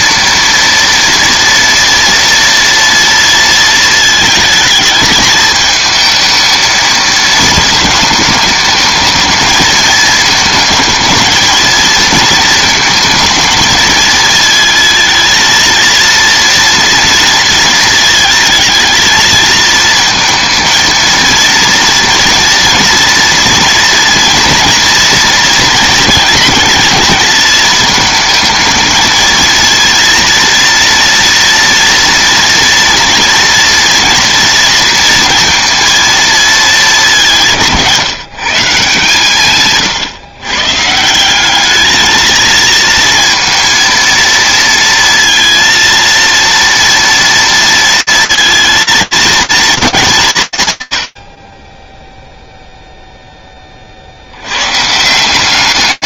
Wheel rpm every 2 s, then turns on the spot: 230, 230, 220, 220, 210, 220, 220, 220, 230, 220, 220, 230, 230, 220, 220, 230, 230, 230, 210, 150, 150, 230, 230, 230, 220, 100, 0, 160.
none